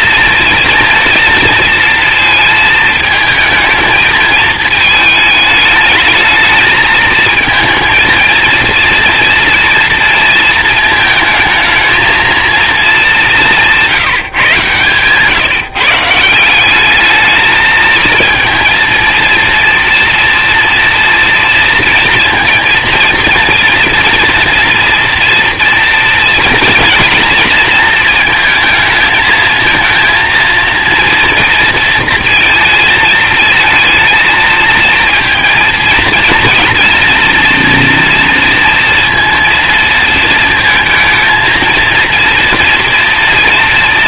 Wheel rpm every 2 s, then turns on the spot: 240, 220, 220, 220, 230, 230, 220, 140, 190, 230, 230, 230, 230, 240, 220, 230, 220, 230, 230, 230, 230, 230.
14-16